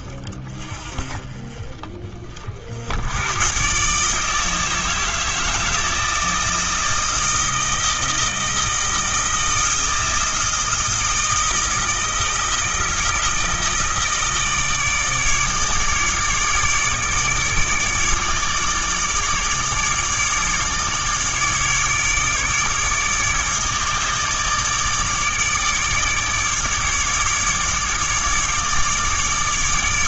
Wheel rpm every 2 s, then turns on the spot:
40, 90, 160, 160, 160, 160, 160, 160, 150, 150, 150, 150, 150, 150, 150.
none